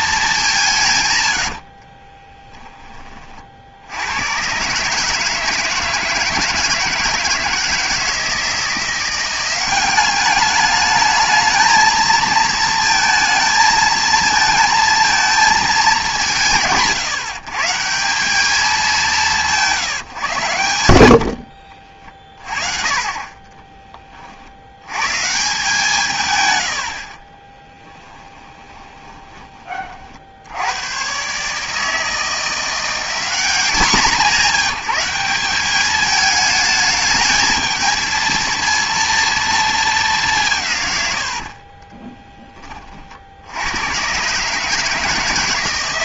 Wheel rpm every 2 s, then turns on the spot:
150, 20, 140, 170, 170, 210, 230, 220, 140, 200, 90, 30, 80, 110, 20, 80, 170, 200, 210, 230, 150, 20, 140.
26-30